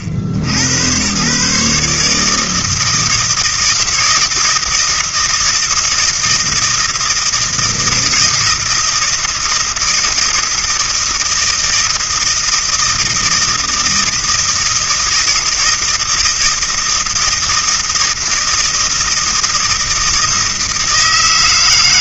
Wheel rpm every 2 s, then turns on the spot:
80, 160, 160, 160, 160, 160, 160, 160, 160, 160, 160.
none